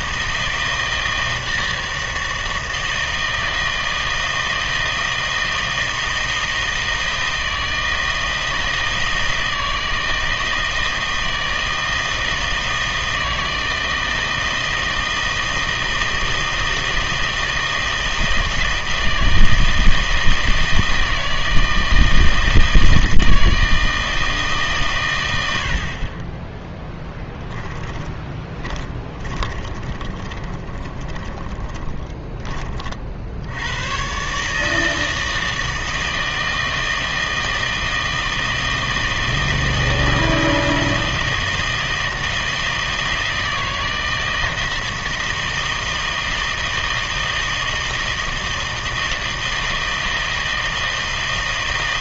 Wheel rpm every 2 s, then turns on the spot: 160, 160, 160, 160, 160, 160, 160, 160, 160, 160, 160, 160, 150, 10, 20, 20, 30, 150, 160, 160, 160, 160, 160, 160, 160, 160.
28-32